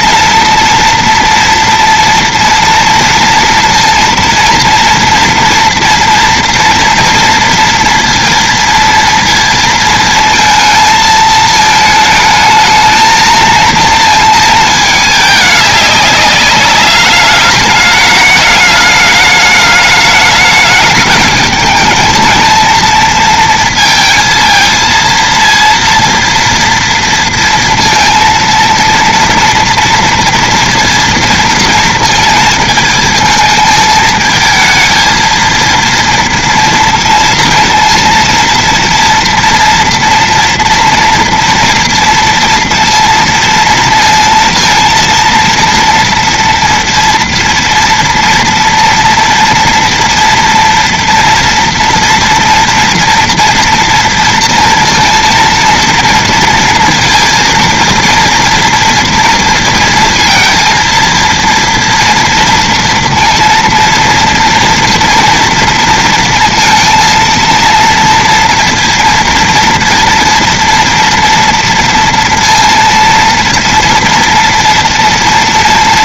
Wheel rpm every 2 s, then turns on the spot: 230, 230, 230, 230, 230, 220, 220, 210, 200, 210, 210, 220, 230, 230, 230, 230, 220, 230, 230, 230, 240, 230, 230, 230, 230, 230, 230, 230, 230, 230, 230, 230, 230, 230, 230, 230, 230, 230.
none